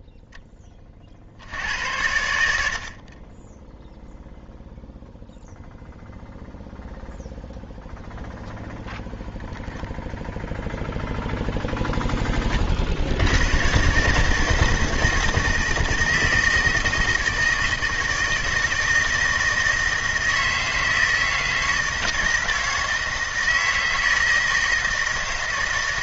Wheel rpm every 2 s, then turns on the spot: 20, 70, 0, 0, 10, 0, 40, 160, 160, 160, 160, 160, 160.
none